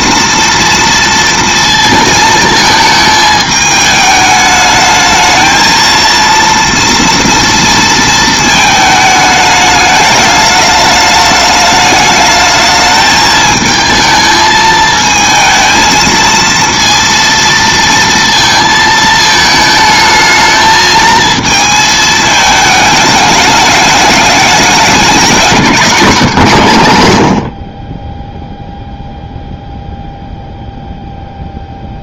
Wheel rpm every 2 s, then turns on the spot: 230, 220, 210, 230, 220, 210, 220, 220, 230, 220, 220, 210, 200, 110, 0, 0.
none